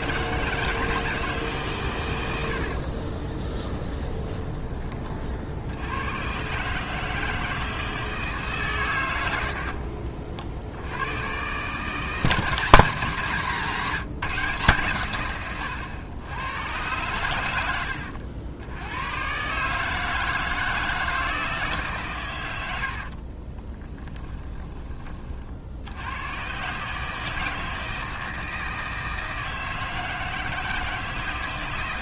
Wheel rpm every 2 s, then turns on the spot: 160, 50, 20, 140, 120, 80, 160, 140, 110, 100, 160, 70, 30, 140, 160, 160.
2-4 22-24